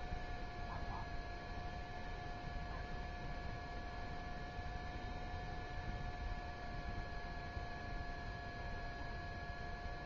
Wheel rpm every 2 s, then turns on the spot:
0, 0, 0, 0, 0.
none